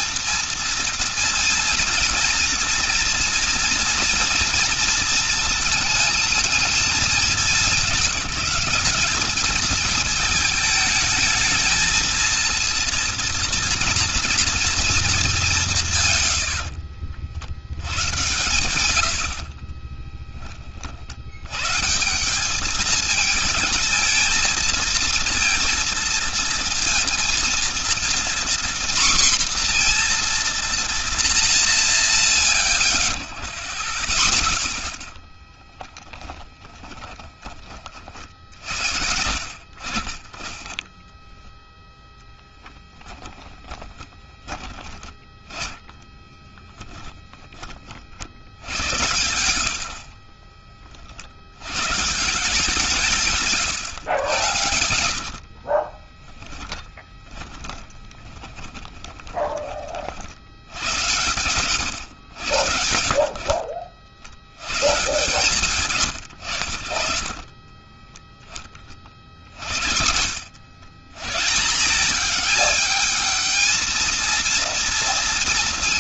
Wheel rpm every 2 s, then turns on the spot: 230, 230, 230, 230, 190, 210, 230, 230, 80, 120, 30, 200, 230, 230, 240, 240, 80, 20, 20, 70, 20, 10, 30, 10, 80, 30, 160, 100, 10, 20, 80, 80, 100, 90, 20, 90, 210, 230.
16-18 36-38 42-48 50-52 56-60